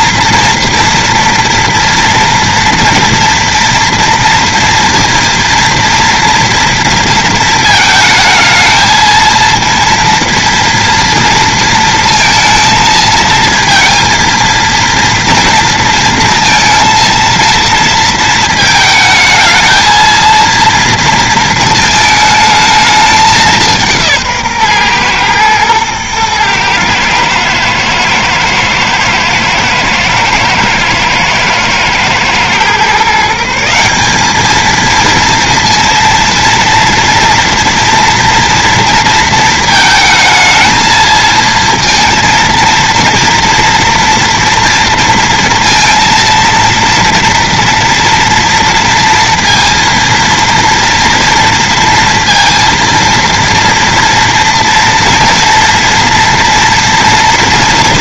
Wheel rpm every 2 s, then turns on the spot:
230, 230, 230, 230, 220, 230, 230, 230, 230, 220, 230, 220, 130, 110, 110, 120, 130, 220, 230, 230, 220, 230, 230, 230, 230, 230, 230, 230, 230.
none